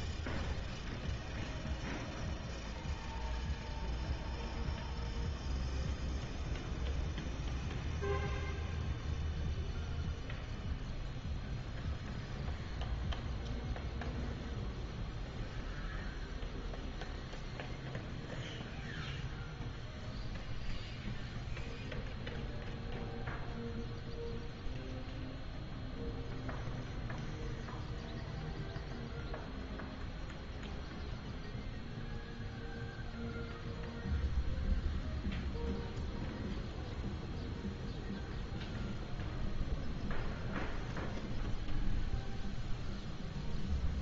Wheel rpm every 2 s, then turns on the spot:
0, 0, 0, 0, 0, 0, 0, 0, 0, 0, 0, 0, 0, 0, 0, 0, 0, 0, 0, 0, 0, 0.
none